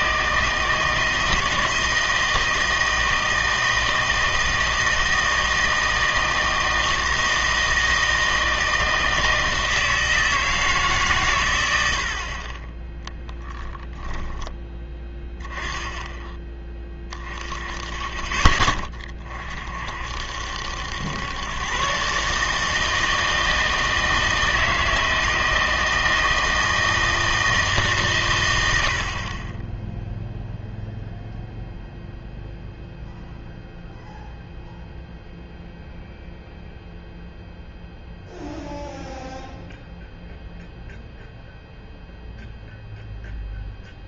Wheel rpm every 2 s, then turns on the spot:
160, 160, 160, 160, 160, 160, 20, 20, 20, 20, 80, 160, 160, 160, 100, 0, 0, 0, 0, 0, 0, 0.
14-16